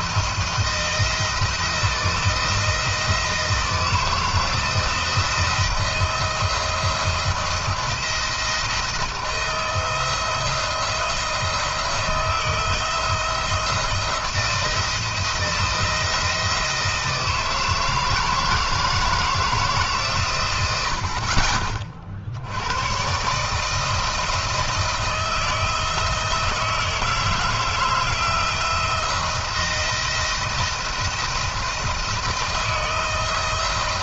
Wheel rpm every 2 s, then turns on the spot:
160, 160, 160, 160, 170, 170, 170, 170, 170, 160, 90, 80, 160, 160, 170, 170, 170.
none